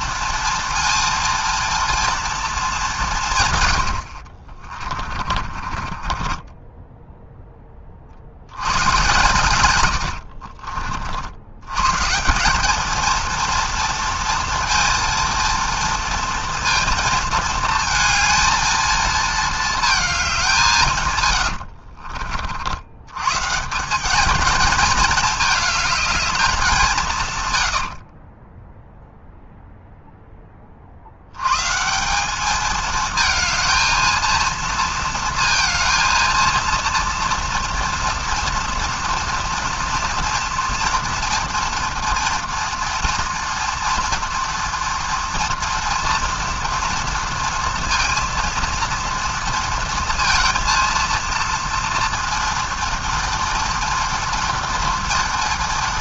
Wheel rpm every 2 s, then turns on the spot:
230, 200, 40, 10, 90, 50, 210, 230, 230, 230, 160, 70, 220, 190, 10, 40, 220, 230, 230, 230, 230, 230, 230, 230, 230, 230, 230, 230.
4-6 28-30